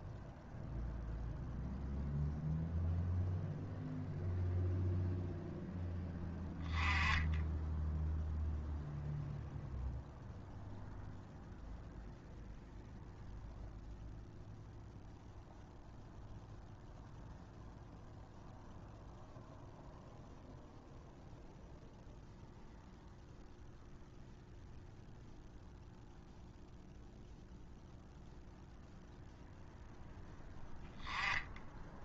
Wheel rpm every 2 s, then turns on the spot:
0, 0, 0, 10, 0, 0, 0, 0, 0, 0, 0, 0, 0, 0, 0, 0.
none